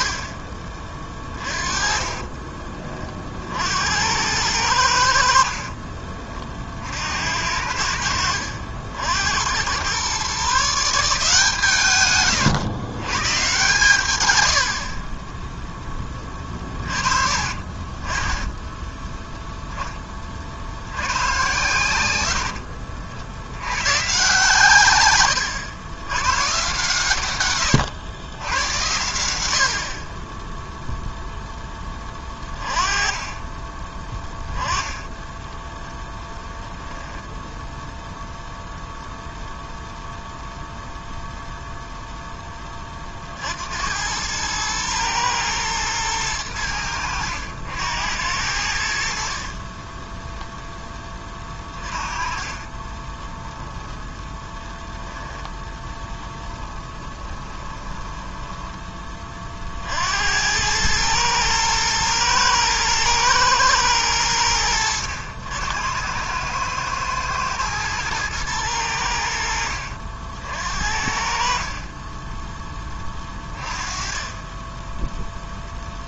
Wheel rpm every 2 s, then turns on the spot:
30, 40, 80, 60, 70, 160, 120, 50, 30, 10, 100, 60, 130, 140, 90, 0, 20, 10, 0, 0, 0, 30, 110, 90, 80, 20, 20, 20, 20, 20, 100, 110, 90, 110, 90, 60, 20, 10.
0-2 14-20 52-58